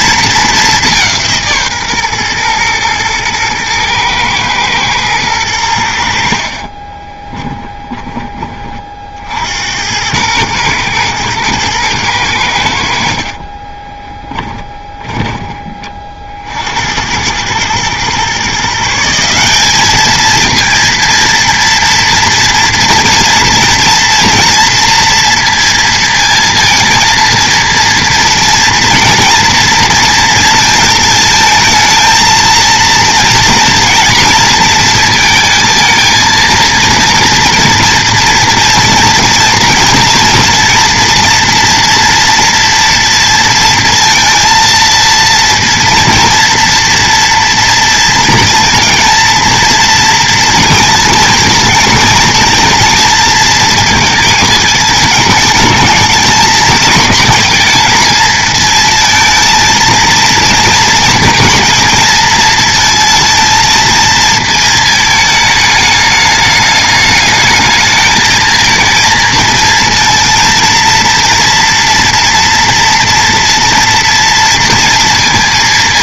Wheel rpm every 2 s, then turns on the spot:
200, 120, 120, 40, 40, 110, 80, 10, 70, 150, 230, 240, 230, 230, 230, 230, 220, 230, 230, 230, 240, 230, 230, 230, 220, 230, 230, 220, 230, 220, 230, 230, 220, 210, 220, 230, 230, 230.
6-8 14-16